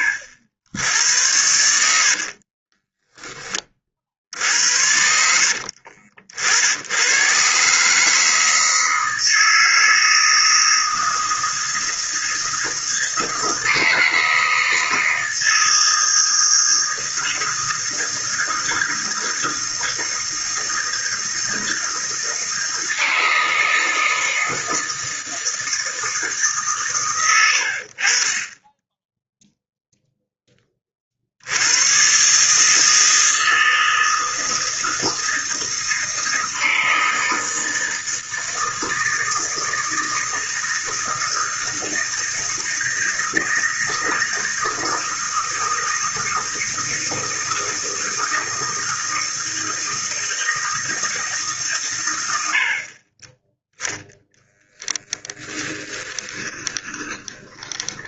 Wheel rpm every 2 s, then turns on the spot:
80, 30, 70, 80, 160, 160, 160, 160, 160, 160, 160, 160, 160, 140, 20, 20, 150, 160, 160, 160, 160, 160, 160, 160, 160, 160, 50, 10, 20.
2-4 54-58